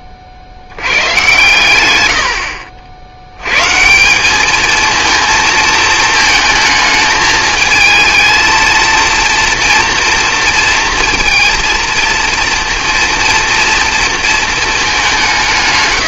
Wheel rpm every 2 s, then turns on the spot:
50, 70, 220, 220, 230, 230, 230, 210.
none